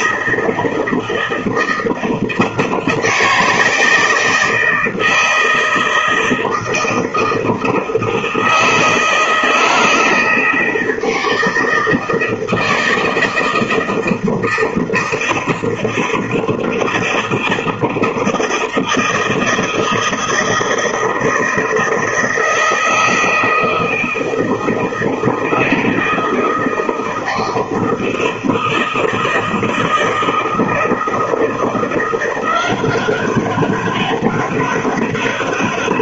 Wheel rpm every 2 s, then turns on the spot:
160, 160, 160, 160, 160, 160, 160, 160, 160, 160, 160, 160, 160, 160, 160, 160, 180, 200.
none